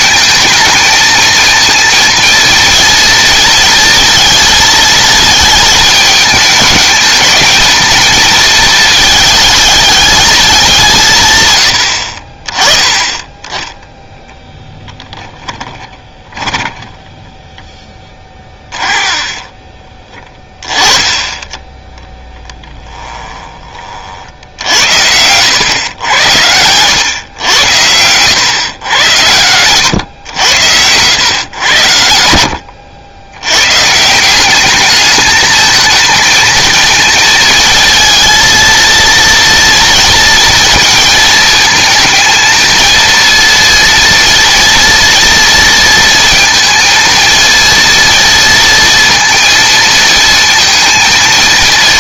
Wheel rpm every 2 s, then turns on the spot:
220, 230, 220, 220, 220, 200, 20, 10, 10, 30, 10, 10, 80, 100, 110, 90, 90, 200, 230, 230, 230, 230, 230, 230, 230, 230.
14-20 22-24